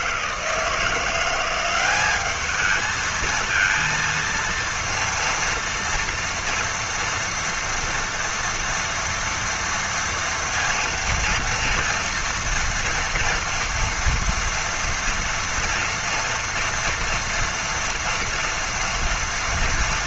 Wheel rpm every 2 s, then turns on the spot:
160, 220, 230, 230, 230, 230, 240, 230, 230, 230.
none